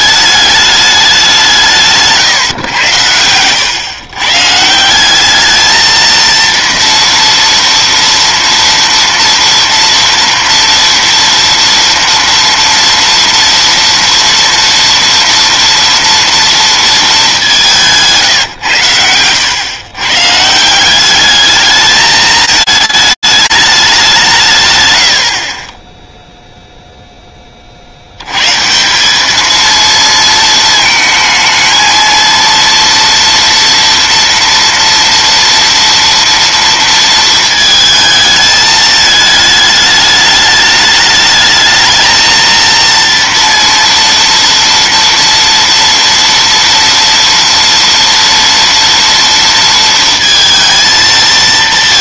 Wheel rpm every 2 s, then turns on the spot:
210, 130, 150, 230, 230, 230, 230, 230, 230, 130, 160, 220, 150, 0, 160, 220, 230, 240, 230, 220, 210, 230, 230, 230, 230, 230.
none